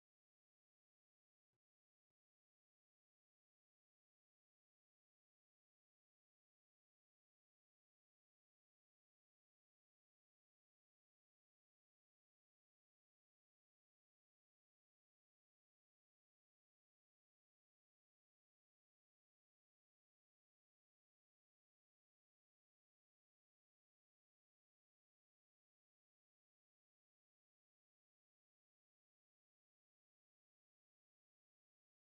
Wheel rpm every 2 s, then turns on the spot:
0, 0, 0, 0, 0, 0, 0, 0, 0, 0, 0, 0, 0, 0, 0, 0.
none